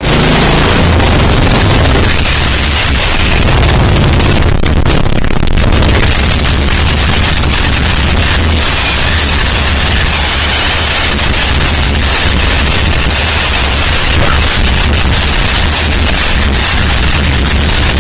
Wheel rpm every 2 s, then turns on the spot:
0, 80, 10, 140, 230, 220, 200, 110, 230.
none